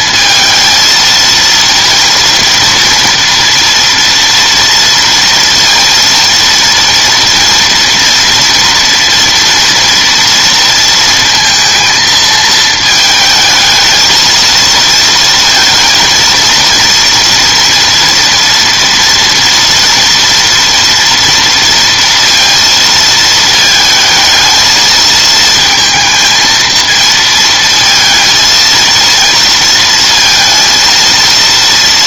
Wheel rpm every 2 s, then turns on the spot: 230, 230, 230, 230, 230, 230, 220, 230, 230, 240, 230, 230, 230, 230, 230, 230.
none